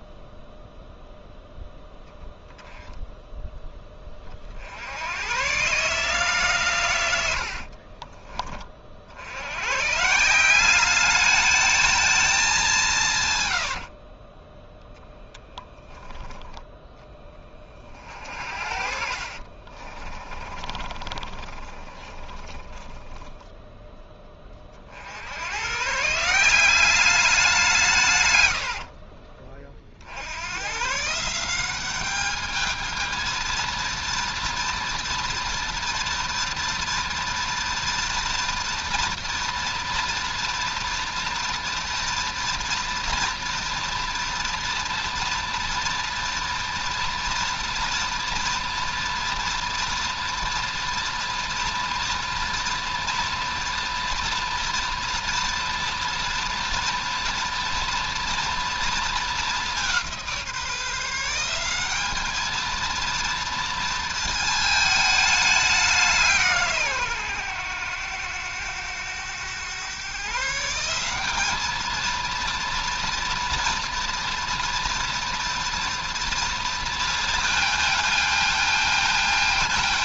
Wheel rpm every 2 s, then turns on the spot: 0, 0, 70, 140, 40, 200, 180, 10, 30, 50, 30, 20, 40, 190, 60, 130, 220, 230, 230, 230, 230, 240, 230, 230, 230, 240, 240, 240, 240, 230, 160, 220, 220, 140, 100, 160, 230, 240, 230, 220.
14-16 18-24 28-30